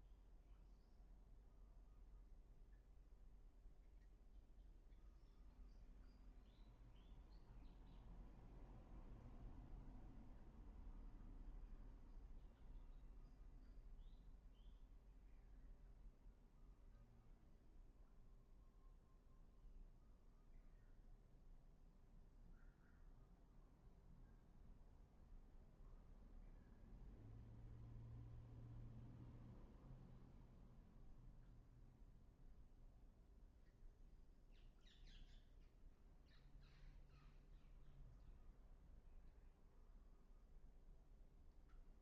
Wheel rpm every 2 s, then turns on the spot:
0, 0, 0, 0, 0, 0, 0, 0, 0, 0, 0, 0, 0, 0, 0, 0, 0, 0, 0, 0, 0.
none